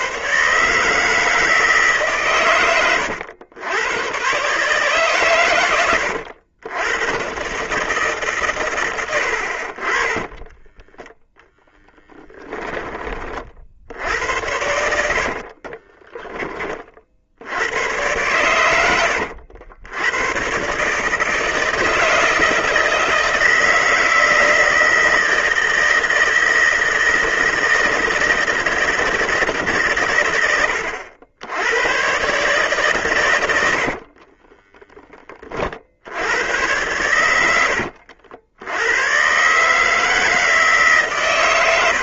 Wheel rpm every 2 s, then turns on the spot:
150, 110, 130, 110, 100, 10, 20, 80, 50, 90, 140, 160, 160, 160, 160, 80, 130, 20, 100, 110, 130.
10-12 14-16